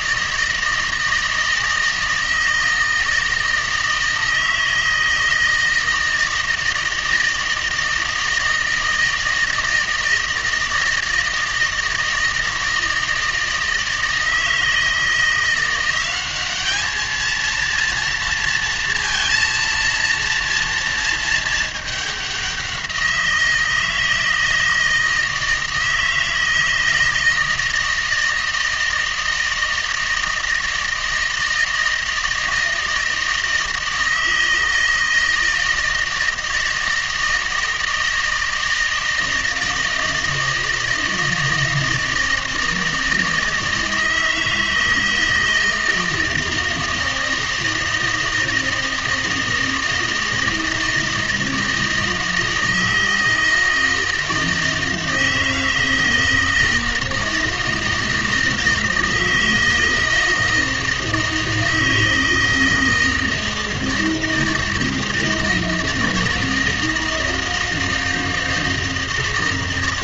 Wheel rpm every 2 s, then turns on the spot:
160, 160, 160, 160, 160, 160, 160, 160, 210, 230, 230, 180, 160, 160, 160, 160, 160, 160, 160, 160, 160, 160, 160, 160, 160, 160, 160, 160, 160, 160, 160, 160, 160, 160, 160.
none